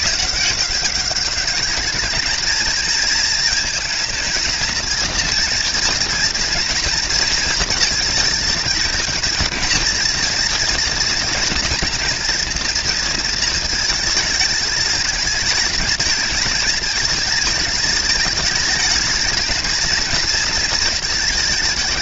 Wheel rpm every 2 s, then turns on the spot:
190, 220, 230, 220, 220, 230, 230, 220, 220, 220, 220.
none